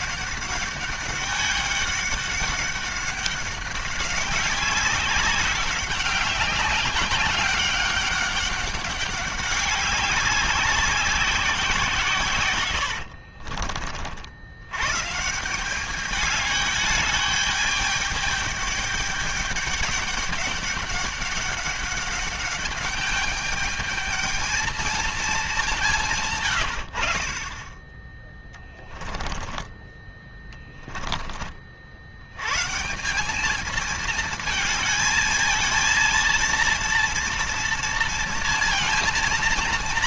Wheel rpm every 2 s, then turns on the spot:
200, 200, 200, 200, 200, 190, 100, 100, 210, 210, 200, 200, 220, 100, 10, 10, 150, 220, 230, 230.
12-14 28-32